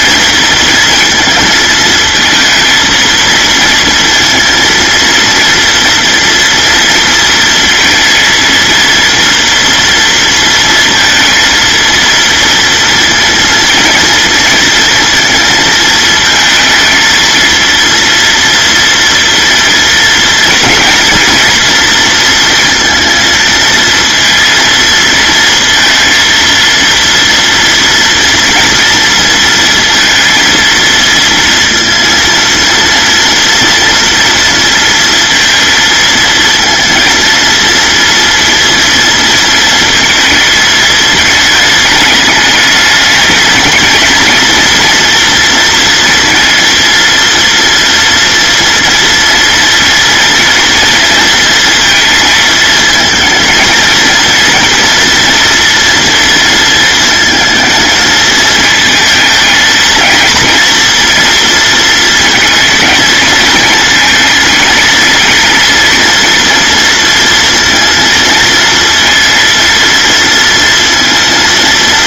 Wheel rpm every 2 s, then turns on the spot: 230, 230, 230, 230, 230, 230, 230, 230, 220, 230, 230, 230, 230, 230, 230, 230, 230, 230, 230, 230, 220, 220, 230, 230, 230, 230, 220, 230, 220, 220, 230, 220, 230, 230, 230, 230.
none